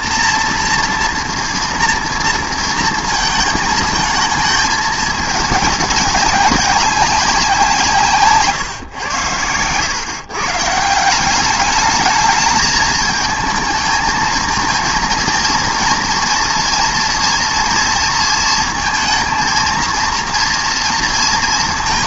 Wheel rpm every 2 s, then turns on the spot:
230, 230, 220, 200, 130, 150, 210, 230, 230, 230, 230.
none